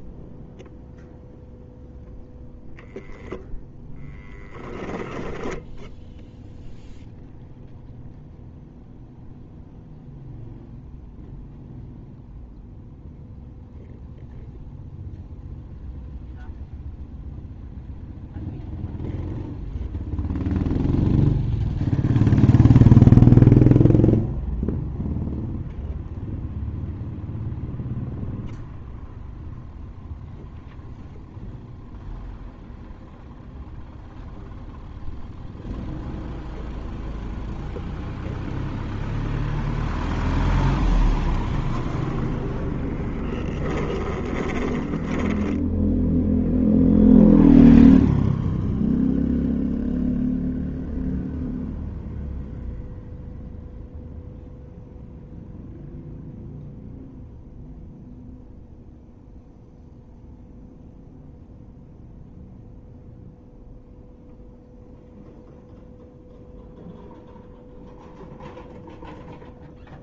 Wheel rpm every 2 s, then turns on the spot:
0, 0, 10, 0, 0, 0, 0, 0, 0, 0, 0, 0, 0, 0, 0, 0, 0, 0, 0, 0, 0, 10, 10, 0, 0, 0, 0, 0, 0, 0, 0, 0, 0, 0, 0.
4-6 44-46